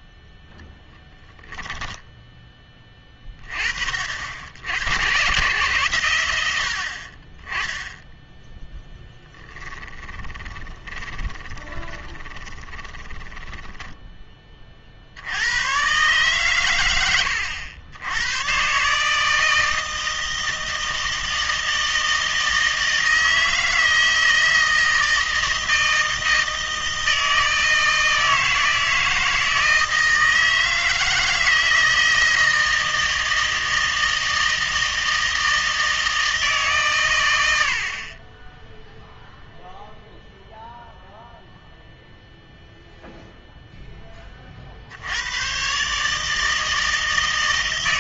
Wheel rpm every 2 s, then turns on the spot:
10, 20, 80, 60, 10, 20, 20, 40, 100, 140, 160, 160, 160, 160, 160, 160, 160, 160, 140, 0, 0, 0, 60, 160.
0-2 10-14